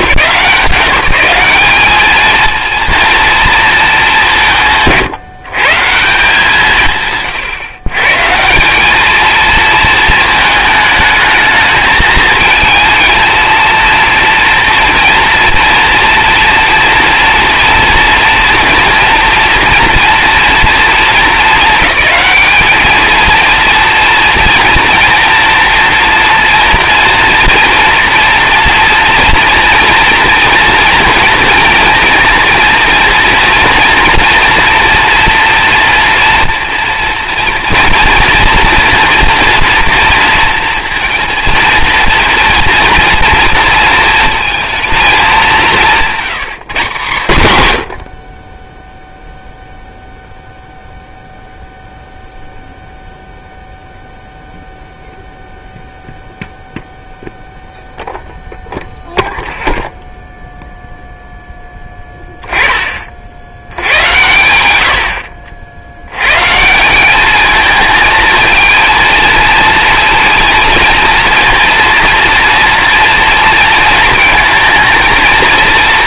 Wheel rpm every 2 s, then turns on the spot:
180, 230, 160, 150, 180, 220, 220, 230, 230, 230, 230, 220, 230, 240, 230, 230, 230, 240, 230, 240, 230, 230, 220, 130, 10, 0, 0, 0, 0, 0, 0, 20, 90, 160, 230, 230, 230, 220.
none